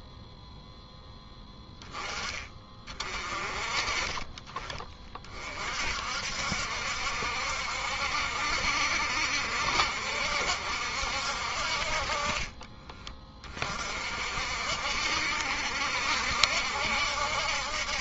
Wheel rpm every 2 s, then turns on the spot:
0, 40, 30, 70, 70, 60, 30, 60, 70.
none